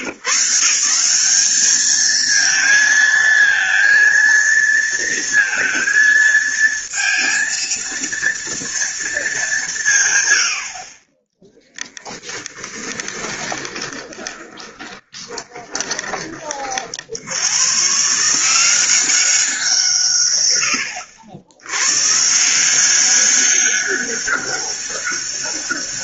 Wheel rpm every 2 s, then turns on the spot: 150, 220, 230, 230, 230, 40, 20, 20, 60, 180, 90, 180, 200.
12-16